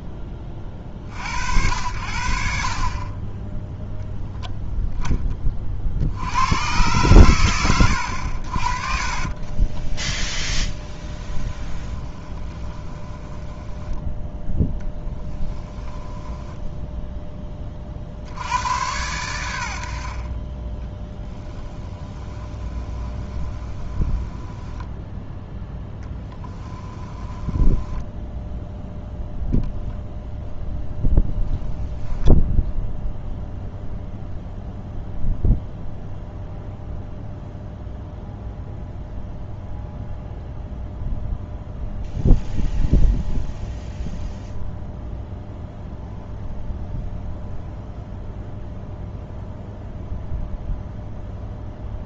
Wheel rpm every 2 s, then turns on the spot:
30, 40, 0, 110, 40, 10, 20, 10, 0, 90, 20, 20, 10, 10, 0, 0, 0, 0, 0, 0, 0, 0, 0, 0, 0, 0.
10-16 22-28